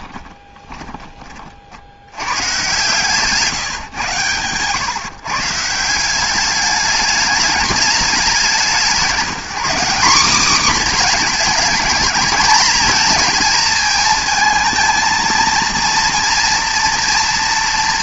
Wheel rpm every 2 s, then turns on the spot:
20, 120, 120, 210, 190, 240, 230, 230, 240.
0-2